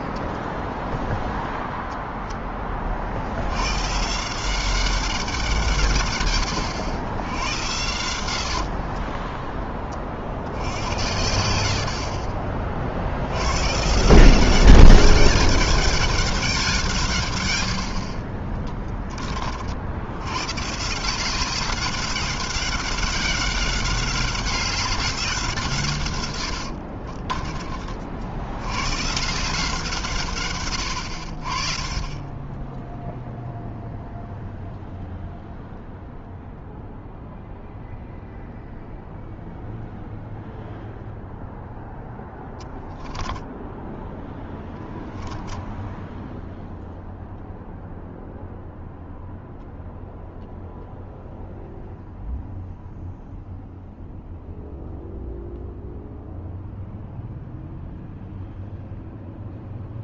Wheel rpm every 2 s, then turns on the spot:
0, 80, 170, 100, 10, 90, 100, 200, 120, 30, 180, 190, 180, 30, 160, 60, 0, 0, 0, 0, 0, 10, 10, 0, 0, 0, 0, 0, 0, 0.
26-28 42-44